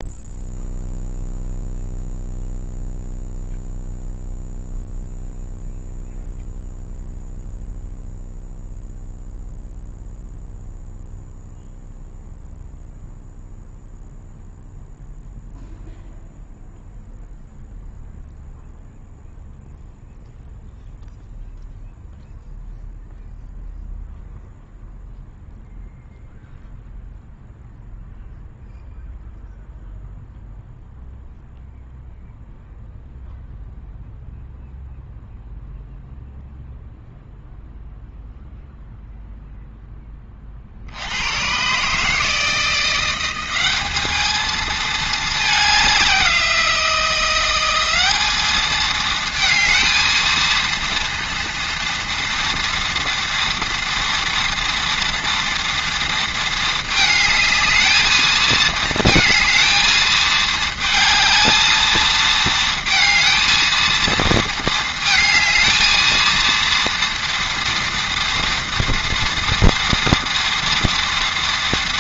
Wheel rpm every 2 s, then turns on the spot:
0, 0, 0, 0, 0, 0, 0, 0, 0, 0, 0, 0, 0, 0, 0, 0, 0, 0, 0, 0, 30, 160, 220, 180, 210, 230, 230, 230, 230, 220, 220, 220, 220, 230, 230, 230.
none